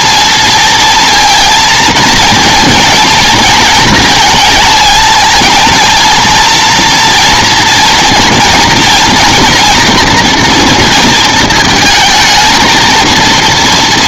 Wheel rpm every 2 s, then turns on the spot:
230, 220, 230, 230, 230, 230, 220.
none